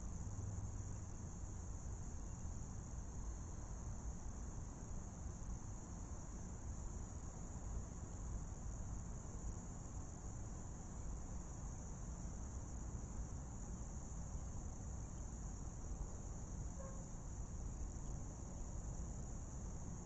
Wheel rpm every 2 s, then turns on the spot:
0, 0, 0, 0, 0, 0, 0, 0, 0, 0.
none